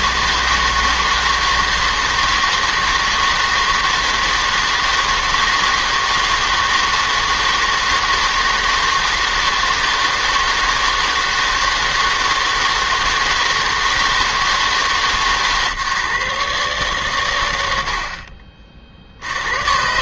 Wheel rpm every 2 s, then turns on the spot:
160, 160, 160, 160, 160, 160, 160, 160, 140, 50.
none